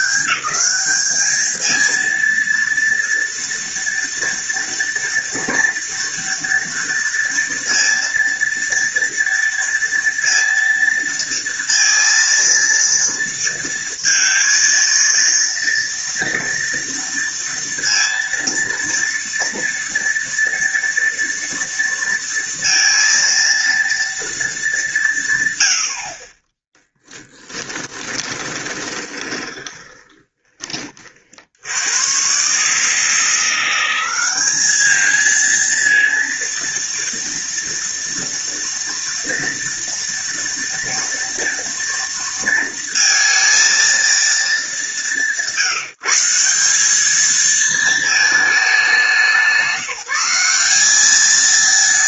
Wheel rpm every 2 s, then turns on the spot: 200, 230, 230, 230, 230, 230, 230, 230, 230, 230, 230, 230, 210, 20, 20, 20, 140, 210, 230, 240, 230, 230, 210, 190, 210, 190.
26-30